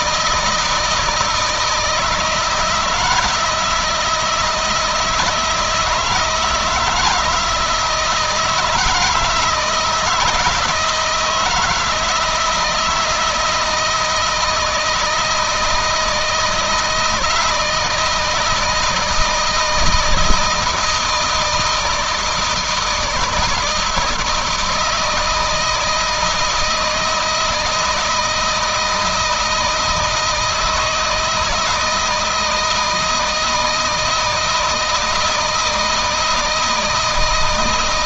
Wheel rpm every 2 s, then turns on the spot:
160, 160, 160, 160, 160, 160, 160, 160, 160, 160, 160, 160, 160, 160, 170, 160, 160, 160, 160.
none